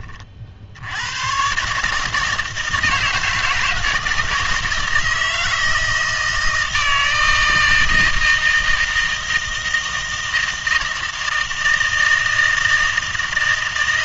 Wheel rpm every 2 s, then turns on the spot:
80, 160, 160, 160, 160, 160, 160.
none